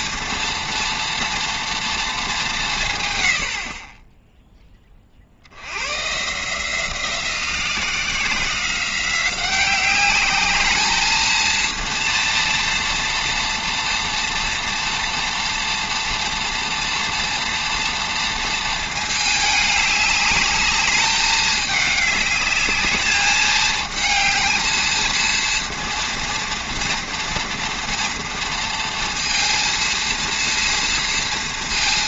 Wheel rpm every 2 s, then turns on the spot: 230, 170, 10, 160, 180, 210, 230, 230, 230, 220, 210, 210, 220, 230, 230, 230.
none